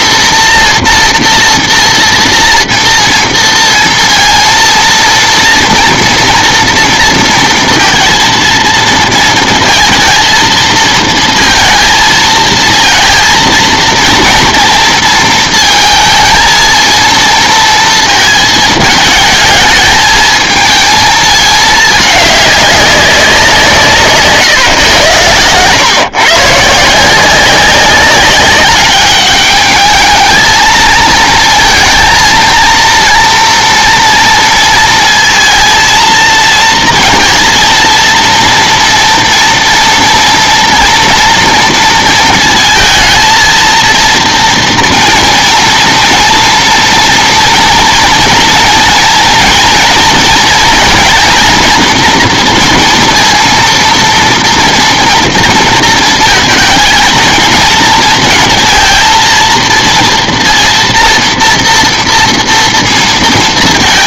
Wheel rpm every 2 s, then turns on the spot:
230, 230, 230, 230, 220, 220, 220, 230, 220, 220, 220, 200, 140, 150, 200, 220, 230, 230, 230, 230, 230, 230, 230, 240, 240, 230, 230, 230, 230, 230, 230, 230.
none